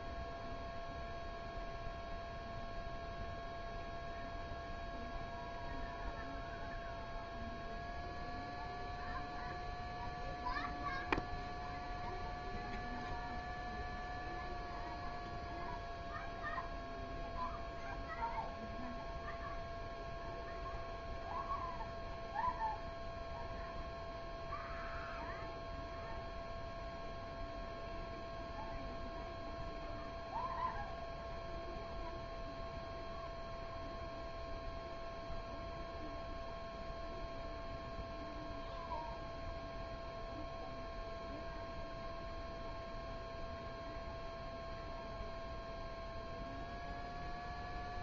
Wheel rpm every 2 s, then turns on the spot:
0, 0, 0, 0, 0, 0, 0, 0, 0, 0, 0, 0, 0, 0, 0, 0, 0, 0, 0, 0, 0, 0, 0, 0.
none